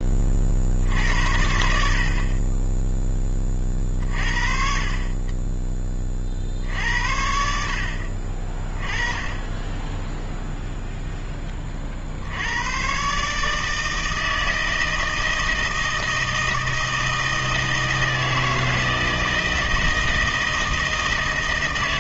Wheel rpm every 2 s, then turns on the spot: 60, 10, 40, 70, 20, 0, 110, 160, 160, 160, 160.
none